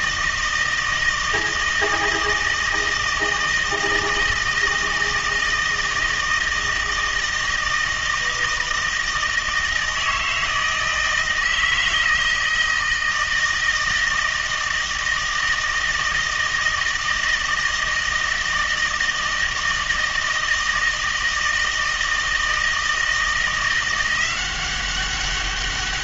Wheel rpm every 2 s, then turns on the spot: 160, 160, 160, 160, 160, 160, 160, 160, 160, 160, 160, 160, 190.
none